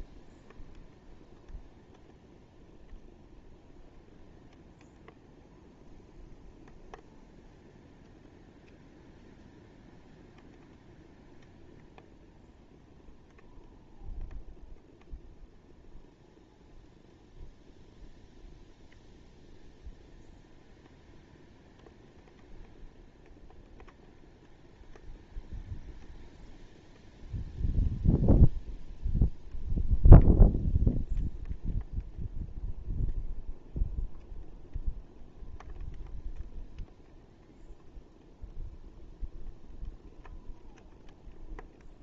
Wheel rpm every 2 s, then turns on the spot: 0, 0, 0, 0, 0, 0, 0, 0, 0, 0, 0, 0, 0, 0, 0, 0, 0, 0, 0, 0, 0.
none